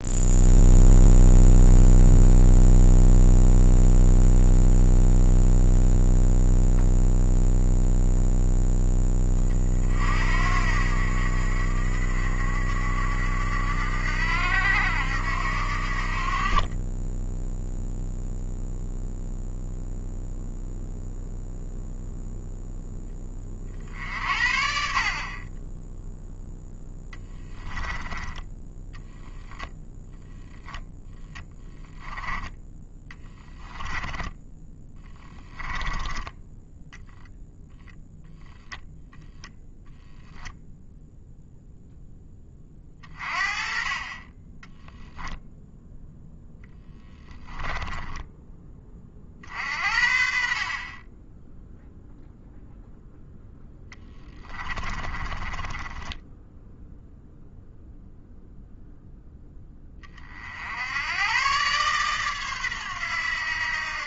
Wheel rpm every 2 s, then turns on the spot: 0, 0, 0, 0, 10, 70, 70, 70, 20, 0, 0, 10, 50, 10, 10, 10, 10, 10, 0, 0, 10, 30, 0, 10, 20, 30, 0, 20, 0, 0, 80, 110.
26-34 46-48 54-56